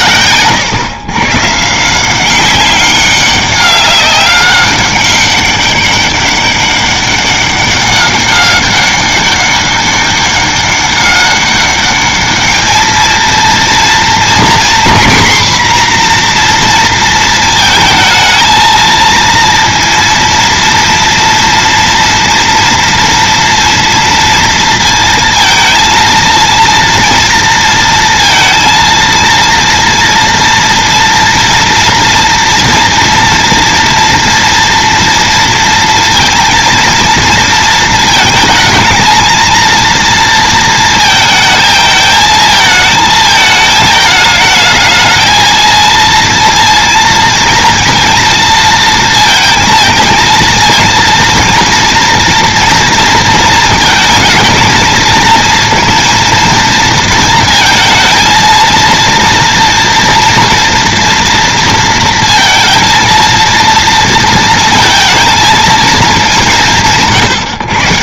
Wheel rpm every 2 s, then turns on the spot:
130, 190, 200, 200, 200, 200, 220, 250, 240, 220, 230, 230, 230, 230, 230, 230, 230, 230, 230, 220, 230, 220, 220, 230, 230, 230, 230, 230, 230, 230, 240, 230, 230, 150.
0-2